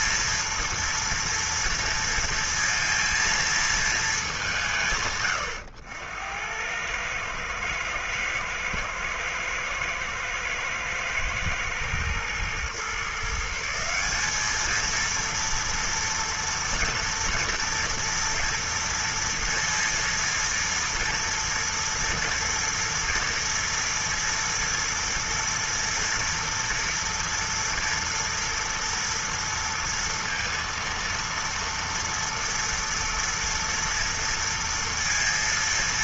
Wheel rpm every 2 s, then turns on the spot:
230, 230, 200, 90, 110, 110, 110, 180, 230, 230, 230, 240, 230, 230, 230, 230, 230, 230.
none